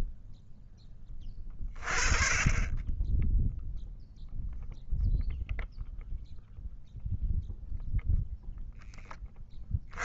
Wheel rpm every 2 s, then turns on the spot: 10, 10, 0, 0, 10.
none